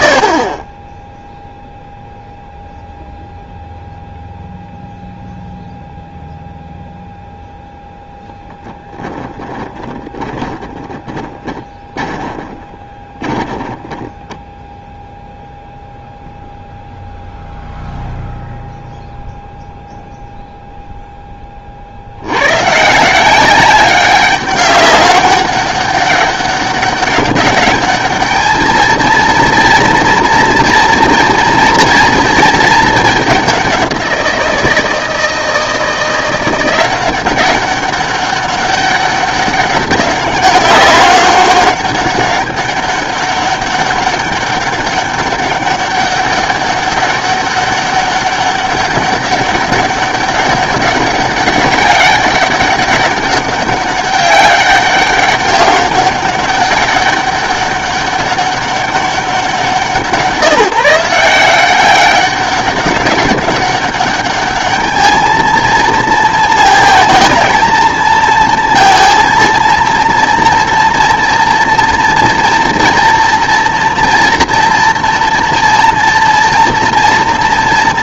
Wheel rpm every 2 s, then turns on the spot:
20, 0, 0, 0, 10, 20, 10, 10, 0, 0, 0, 130, 200, 200, 220, 230, 220, 170, 180, 200, 200, 200, 200, 200, 200, 200, 190, 200, 200, 200, 160, 200, 210, 230, 230, 230, 230, 230, 230.
8-14